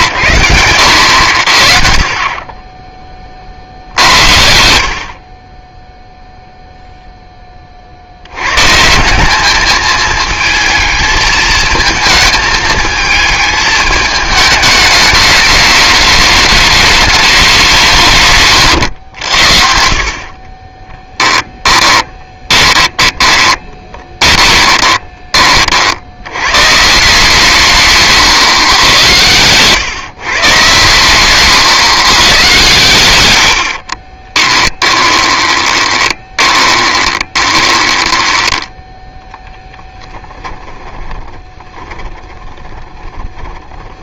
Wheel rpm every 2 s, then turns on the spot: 90, 10, 70, 0, 120, 220, 220, 210, 210, 130, 30, 20, 20, 120, 130, 130, 120, 20, 20, 10, 10, 20.
22-26 34-38 40-44